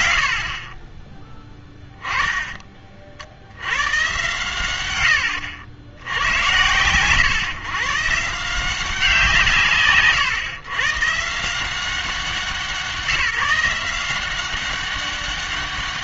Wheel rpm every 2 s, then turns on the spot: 80, 20, 90, 120, 170, 120, 180, 190.
4-6